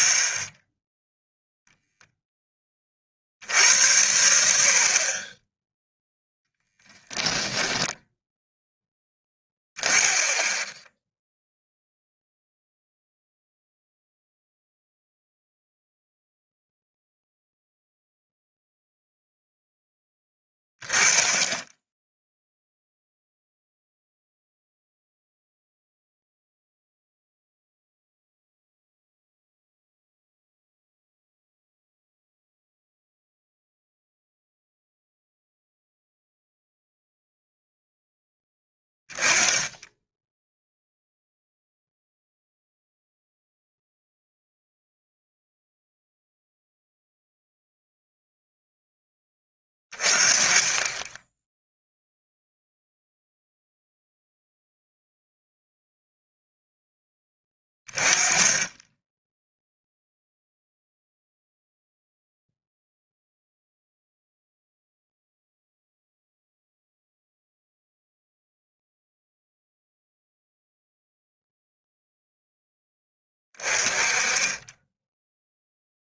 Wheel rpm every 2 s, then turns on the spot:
10, 30, 60, 20, 10, 0, 0, 0, 0, 0, 10, 0, 0, 0, 0, 0, 0, 0, 0, 10, 0, 0, 0, 0, 0, 20, 0, 0, 10, 20, 0, 0, 0, 0, 0, 0, 10, 10.
6-8